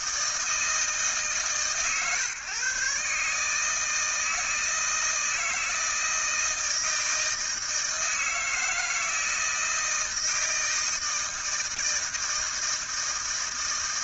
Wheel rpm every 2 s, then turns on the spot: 150, 140, 160, 160, 160, 160, 160.
none